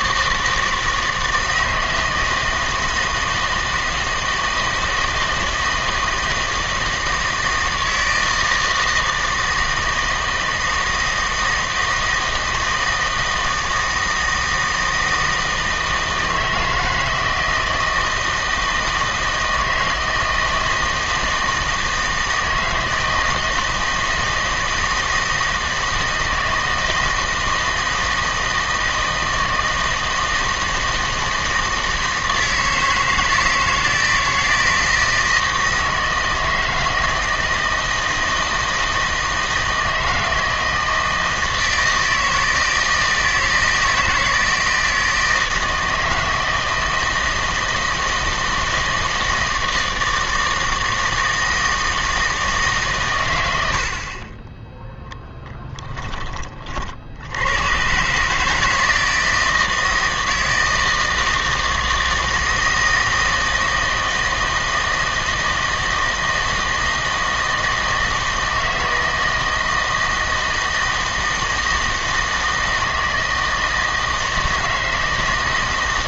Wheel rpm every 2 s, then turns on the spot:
160, 160, 160, 160, 160, 160, 160, 160, 160, 160, 160, 160, 160, 160, 160, 160, 160, 170, 160, 160, 160, 160, 160, 160, 160, 160, 150, 10, 40, 160, 160, 160, 160, 160, 160, 160, 160, 160.
none